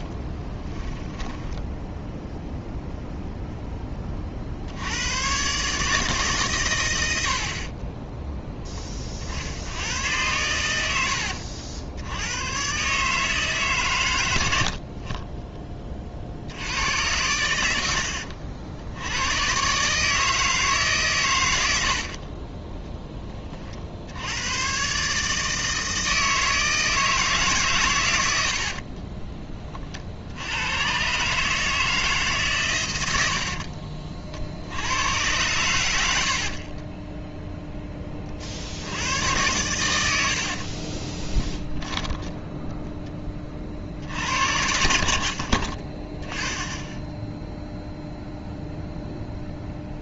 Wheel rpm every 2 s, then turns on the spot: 10, 0, 70, 120, 20, 80, 130, 60, 80, 70, 150, 20, 120, 160, 60, 100, 130, 70, 30, 70, 50, 0, 70, 10, 0.
0-2 28-30 36-38 40-42